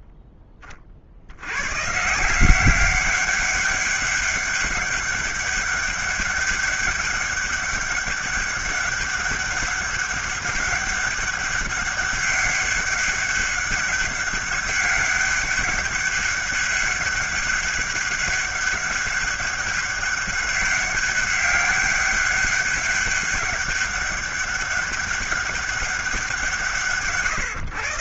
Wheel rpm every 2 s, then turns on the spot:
20, 180, 200, 200, 200, 200, 200, 200, 200, 200, 200, 200, 190, 160.
none